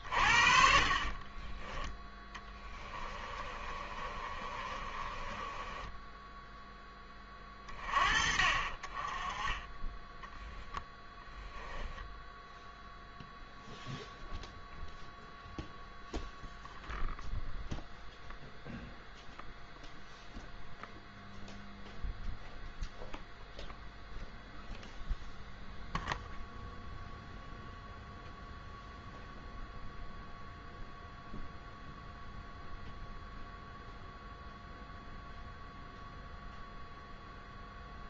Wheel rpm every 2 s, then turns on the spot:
40, 20, 30, 10, 40, 10, 0, 0, 0, 0, 0, 0, 0, 0, 0, 0, 0, 0, 0.
0-6 10-12